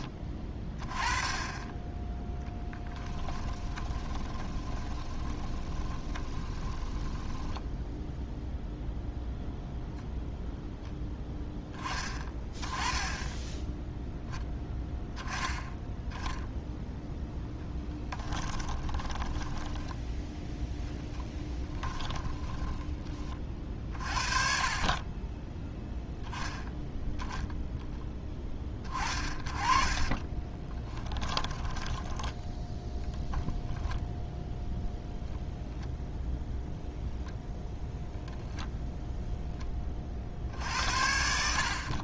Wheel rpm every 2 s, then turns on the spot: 20, 10, 20, 20, 0, 0, 10, 10, 0, 30, 10, 10, 30, 10, 20, 20, 0, 0, 0, 0, 80.
2-8 18-22 30-32